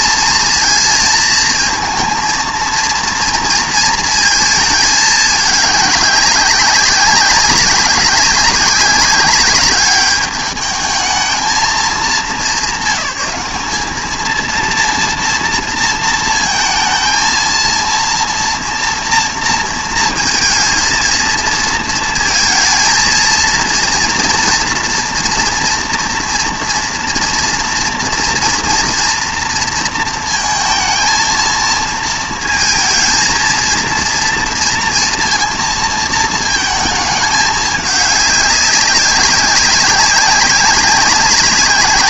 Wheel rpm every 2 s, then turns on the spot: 230, 230, 220, 190, 200, 210, 200, 230, 230, 230, 230, 230, 230, 230, 230, 220, 220, 230, 220, 200, 190.
none